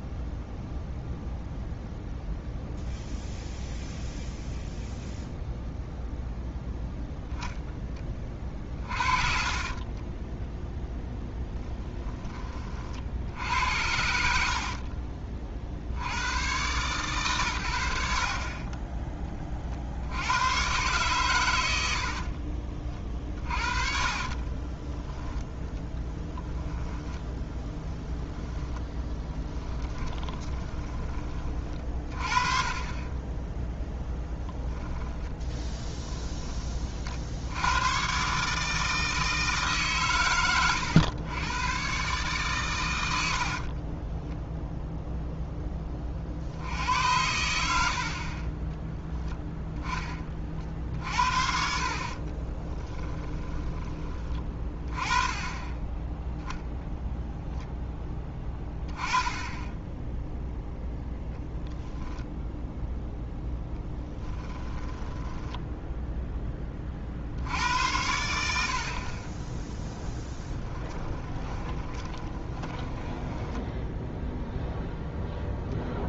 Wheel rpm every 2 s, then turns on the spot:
0, 0, 0, 0, 40, 0, 50, 50, 120, 30, 120, 40, 20, 10, 10, 20, 20, 10, 50, 160, 100, 100, 0, 80, 10, 50, 10, 20, 0, 10, 0, 0, 10, 40, 50, 10, 20, 10.
8-10 14-16 24-26 28-32 34-36 48-54 64-66 70-74